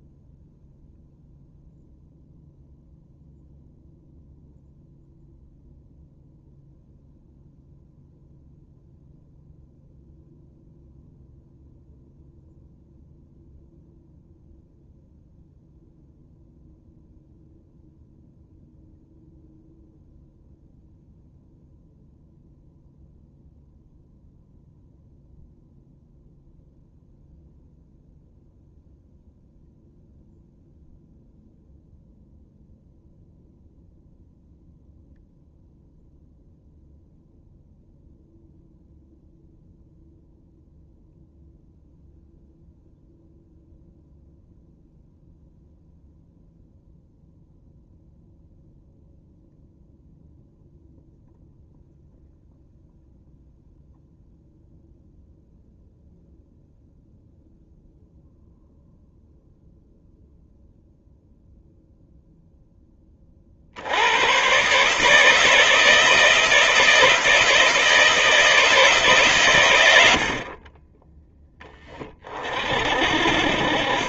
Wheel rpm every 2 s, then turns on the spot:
0, 0, 0, 0, 0, 0, 0, 0, 0, 0, 0, 0, 0, 0, 0, 0, 0, 0, 0, 0, 0, 0, 0, 0, 0, 0, 0, 0, 0, 0, 0, 10, 140, 170, 150, 20, 50.
none